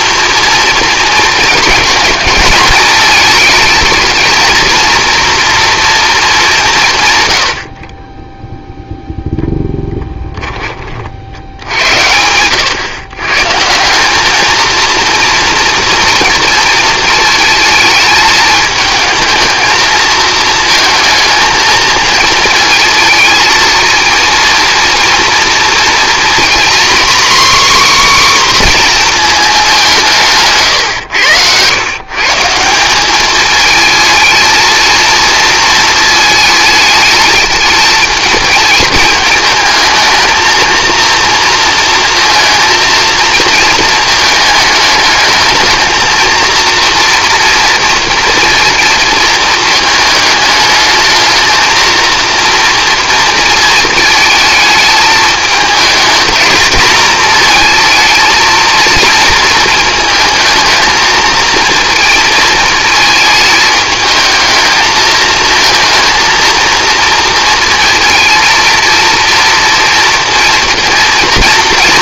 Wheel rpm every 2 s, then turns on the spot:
230, 220, 230, 170, 0, 30, 110, 220, 220, 220, 220, 230, 230, 250, 260, 140, 170, 220, 220, 220, 230, 230, 220, 230, 230, 210, 230, 220, 230, 230, 220, 220, 220, 230, 230, 230.
none